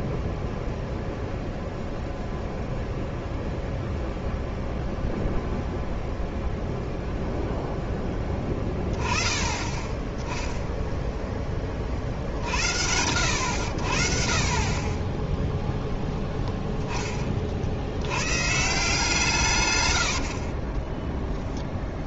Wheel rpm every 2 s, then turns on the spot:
0, 0, 0, 0, 10, 0, 70, 30, 10, 150, 20.
none